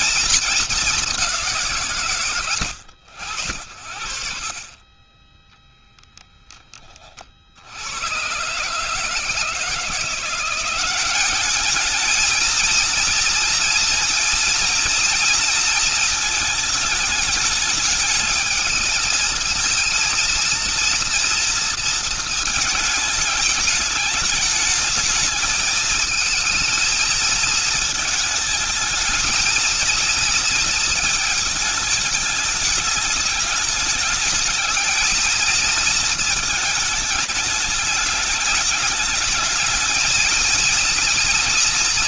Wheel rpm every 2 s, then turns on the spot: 220, 80, 40, 10, 120, 180, 230, 230, 220, 220, 230, 220, 210, 220, 220, 230, 210, 220, 220, 210, 230.
none